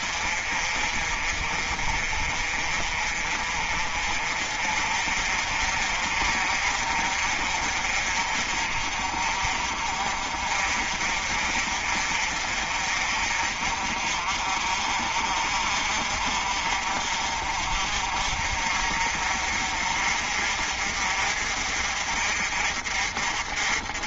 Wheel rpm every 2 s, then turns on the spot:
40, 40, 40, 50, 50, 50, 50, 50, 50, 50, 50, 50.
none